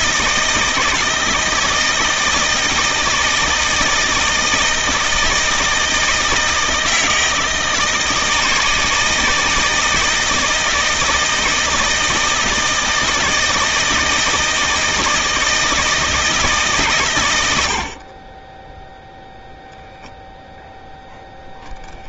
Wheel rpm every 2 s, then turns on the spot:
160, 160, 160, 160, 160, 160, 160, 160, 140, 0, 0.
none